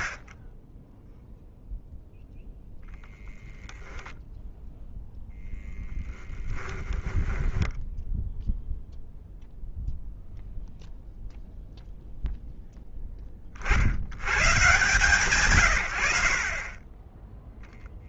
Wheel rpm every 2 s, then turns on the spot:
10, 0, 0, 20, 0, 0, 10, 130, 20.
6-8